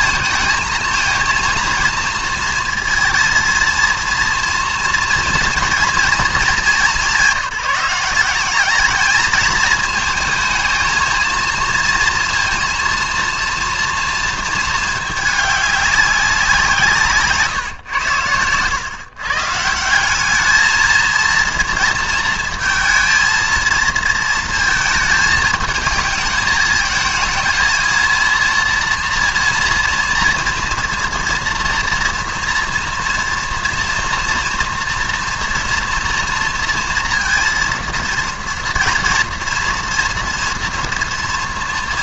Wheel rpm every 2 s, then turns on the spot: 230, 230, 230, 210, 200, 220, 230, 220, 180, 110, 210, 220, 220, 220, 230, 230, 230, 240, 230, 240, 230.
none